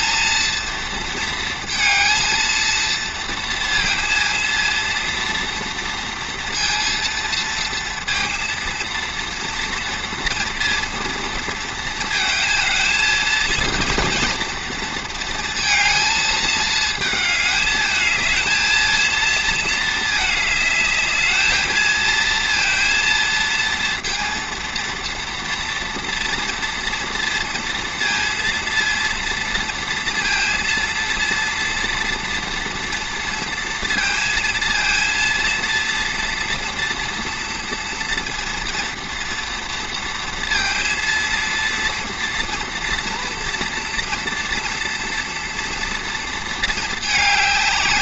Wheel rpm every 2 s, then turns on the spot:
230, 230, 230, 230, 230, 230, 220, 230, 220, 220, 210, 230, 230, 230, 230, 230, 230, 230, 230, 230, 230, 230, 230, 220.
none